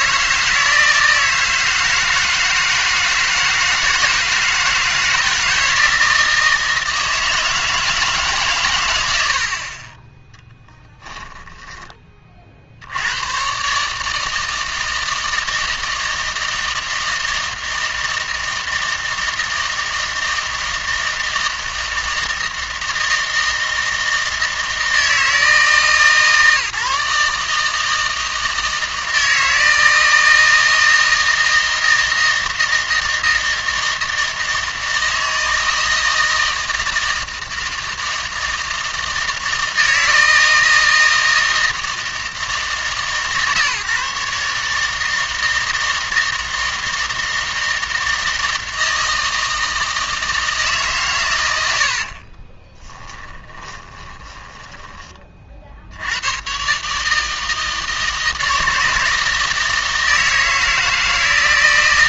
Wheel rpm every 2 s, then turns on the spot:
160, 160, 160, 160, 120, 10, 80, 160, 160, 160, 160, 160, 160, 150, 160, 160, 160, 160, 160, 160, 160, 160, 150, 160, 160, 150, 20, 20, 130, 160, 160.
10-12 52-56